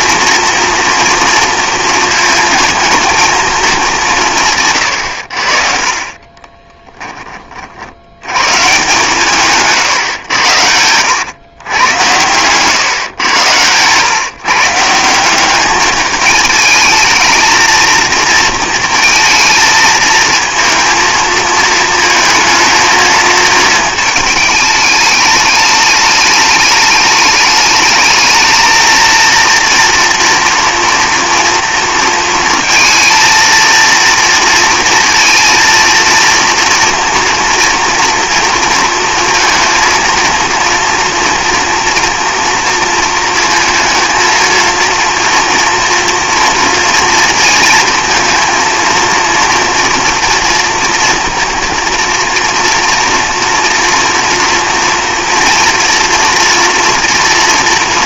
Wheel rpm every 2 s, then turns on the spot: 230, 230, 110, 10, 130, 90, 120, 150, 220, 230, 220, 230, 210, 210, 220, 230, 230, 230, 230, 230, 230, 230, 230, 230, 230, 230, 230, 230, 230.
6-8 10-12